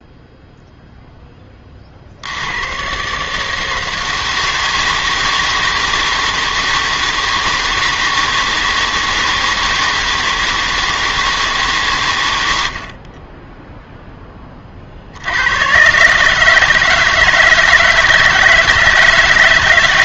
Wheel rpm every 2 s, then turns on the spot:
0, 90, 160, 160, 160, 160, 80, 30, 150, 160.
none